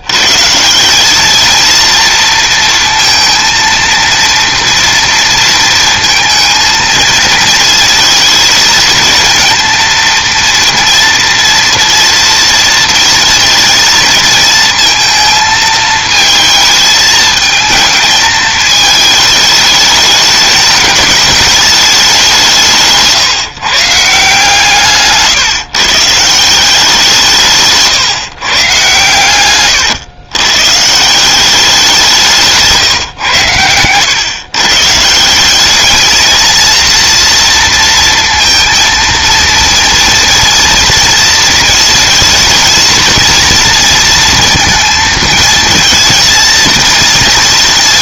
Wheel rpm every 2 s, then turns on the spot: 190, 230, 230, 220, 230, 240, 230, 230, 220, 220, 220, 160, 140, 180, 120, 160, 140, 150, 230, 230, 230, 230, 220, 230.
none